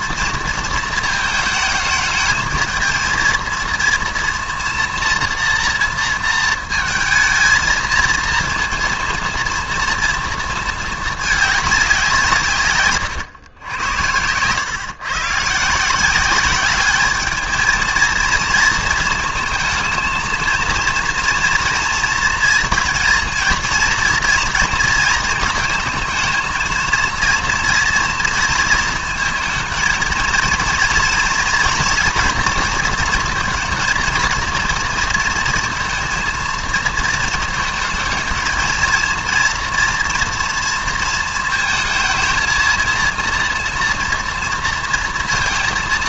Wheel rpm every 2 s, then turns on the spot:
230, 220, 230, 230, 230, 220, 140, 110, 190, 230, 230, 230, 230, 230, 230, 230, 230, 230, 230, 220, 230, 230, 230.
none